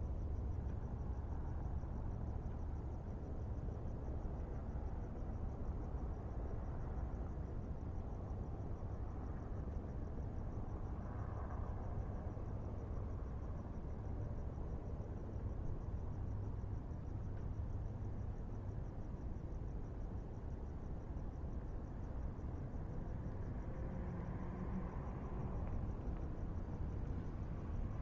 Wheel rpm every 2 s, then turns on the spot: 0, 0, 0, 0, 0, 0, 0, 0, 0, 0, 0, 0, 0, 0.
none